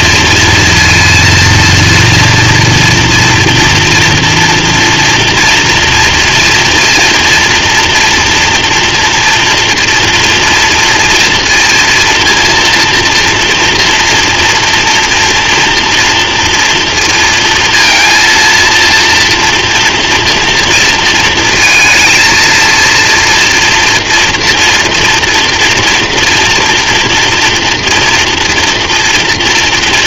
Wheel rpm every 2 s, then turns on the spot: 230, 230, 230, 230, 230, 230, 230, 230, 230, 230, 230, 230, 240, 230, 240.
none